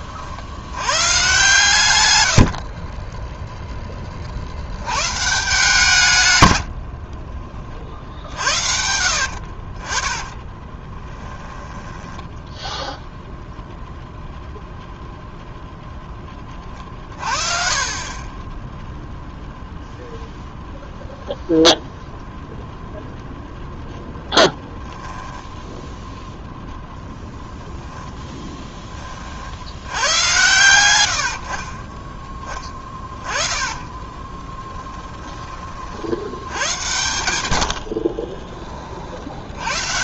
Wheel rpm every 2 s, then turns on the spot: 70, 50, 80, 80, 70, 30, 10, 0, 30, 10, 0, 0, 0, 0, 10, 100, 20, 20, 90, 30.
2-4 6-8 10-12 32-36